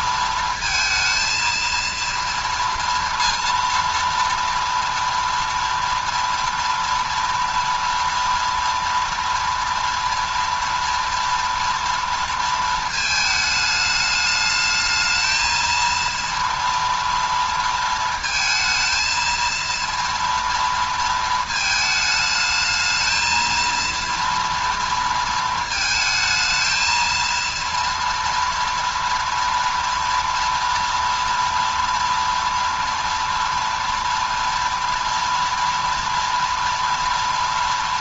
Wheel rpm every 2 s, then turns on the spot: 230, 230, 230, 230, 230, 230, 230, 210, 230, 220, 230, 220, 230, 220, 230, 230, 230, 230, 230.
none